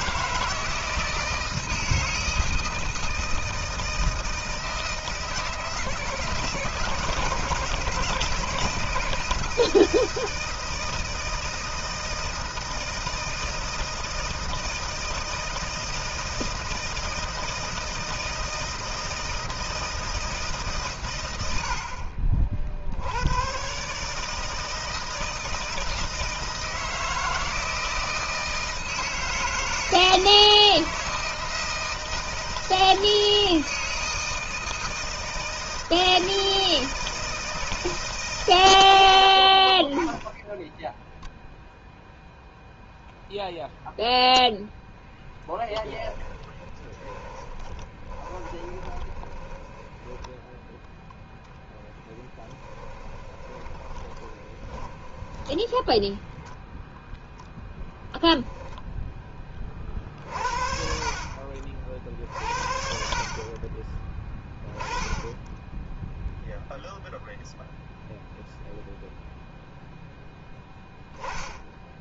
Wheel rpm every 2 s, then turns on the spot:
160, 160, 160, 160, 160, 160, 160, 160, 160, 160, 130, 60, 160, 160, 160, 160, 160, 160, 160, 90, 0, 0, 0, 10, 20, 0, 10, 10, 0, 0, 50, 50, 10, 0, 0, 10.
46-50 52-56